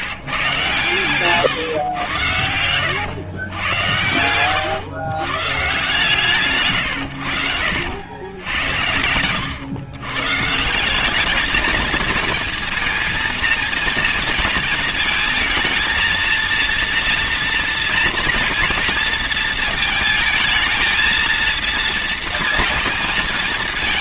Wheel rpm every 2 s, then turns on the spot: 130, 100, 110, 130, 90, 160, 230, 220, 230, 230, 220, 230.
2-4